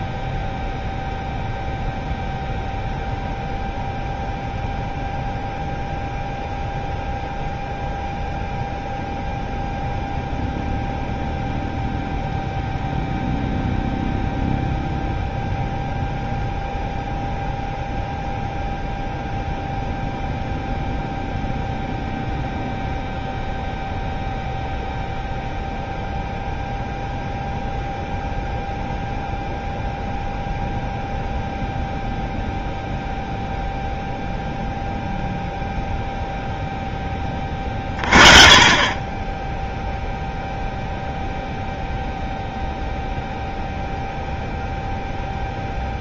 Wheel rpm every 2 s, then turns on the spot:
0, 0, 0, 0, 0, 0, 0, 0, 0, 0, 0, 0, 0, 0, 0, 0, 0, 0, 0, 30, 0, 0, 0.
none